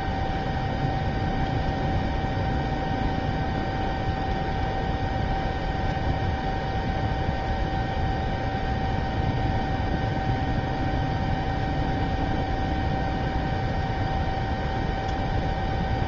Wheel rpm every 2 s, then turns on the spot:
0, 0, 0, 0, 0, 0, 0, 0.
none